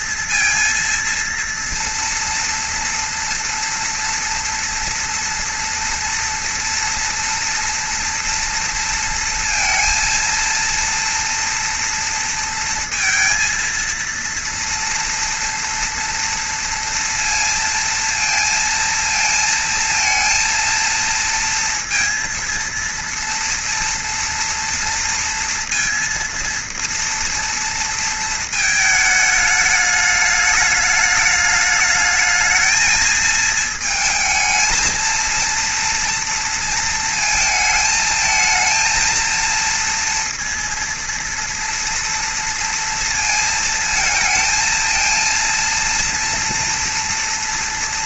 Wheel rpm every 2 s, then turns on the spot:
230, 240, 240, 230, 230, 230, 230, 230, 230, 230, 230, 230, 230, 230, 220, 210, 220, 220, 230, 230, 230, 230, 220, 240.
none